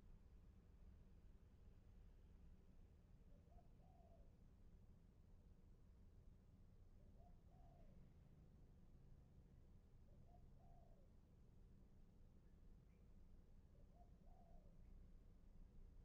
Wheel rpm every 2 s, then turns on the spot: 0, 0, 0, 0, 0, 0, 0, 0.
none